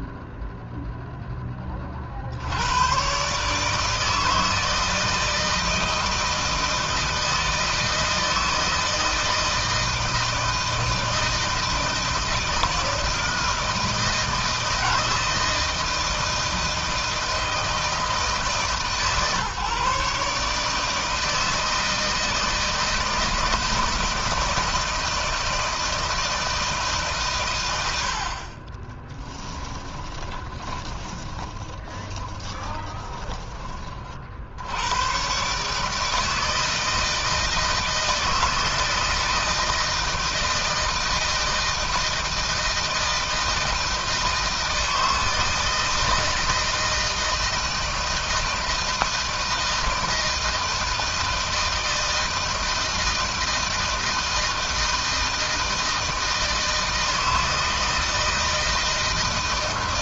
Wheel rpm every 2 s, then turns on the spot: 0, 110, 160, 160, 160, 160, 160, 160, 160, 140, 160, 160, 160, 150, 20, 10, 10, 100, 160, 160, 160, 160, 160, 160, 160, 160, 160, 160, 160, 160.
28-34